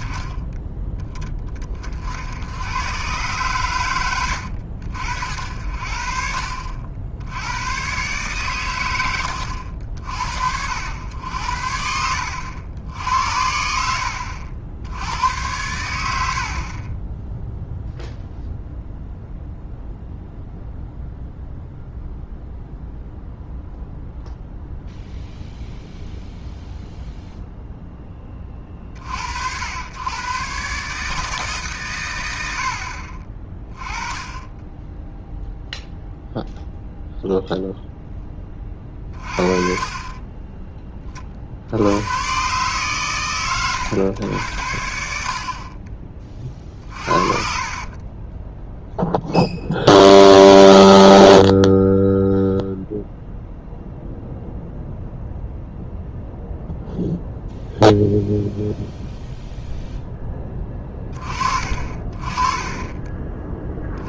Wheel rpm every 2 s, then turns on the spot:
10, 100, 70, 60, 120, 70, 80, 70, 50, 0, 0, 0, 0, 0, 30, 130, 80, 20, 0, 20, 20, 130, 80, 40, 10, 0, 0, 0, 0, 0, 20, 30.
46-48